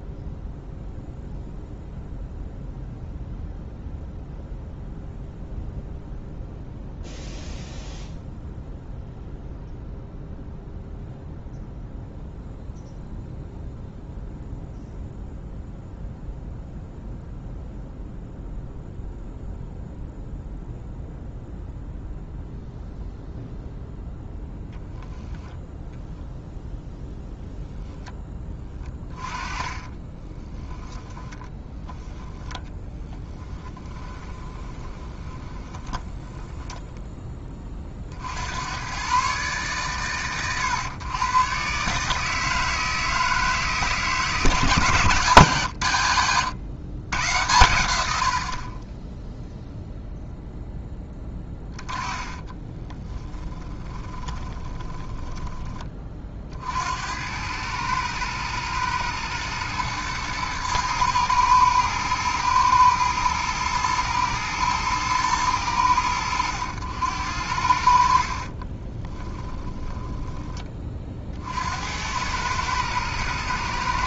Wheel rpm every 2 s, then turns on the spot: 0, 0, 0, 0, 0, 0, 0, 0, 0, 0, 0, 0, 0, 0, 20, 10, 10, 20, 10, 100, 110, 160, 140, 90, 20, 10, 10, 20, 70, 110, 110, 110, 110, 90, 30, 30, 110.
28-32 34-38 52-56 68-70